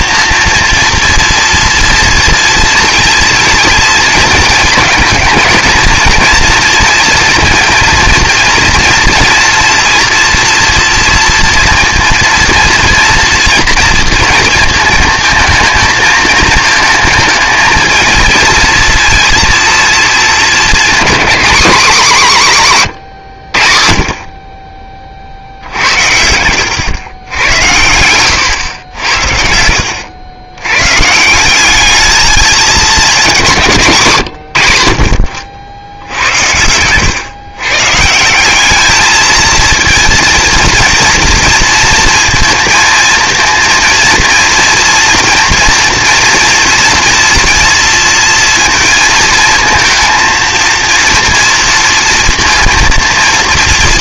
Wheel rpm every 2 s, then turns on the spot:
230, 230, 220, 230, 230, 230, 230, 230, 230, 230, 230, 180, 20, 100, 100, 100, 210, 110, 100, 200, 230, 230, 230, 230, 230, 230, 230.
none